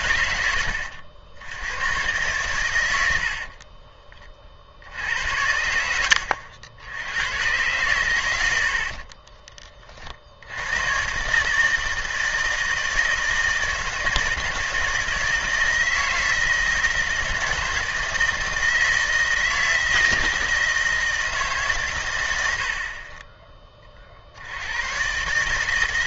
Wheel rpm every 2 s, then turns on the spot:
80, 110, 60, 80, 80, 100, 160, 160, 160, 160, 160, 70, 90.
22-24